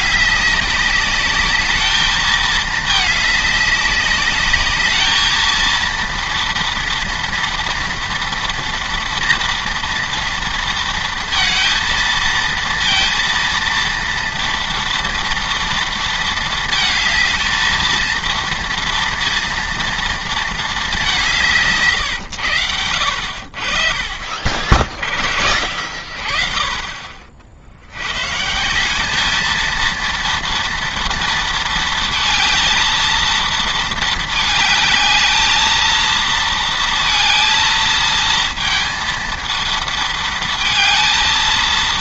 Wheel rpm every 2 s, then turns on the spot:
210, 210, 200, 230, 230, 240, 230, 230, 230, 230, 230, 130, 50, 50, 130, 230, 230, 220, 230, 230, 220.
22-24